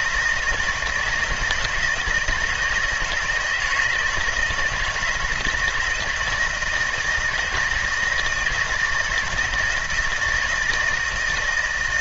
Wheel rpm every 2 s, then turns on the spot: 160, 160, 170, 160, 160, 160.
none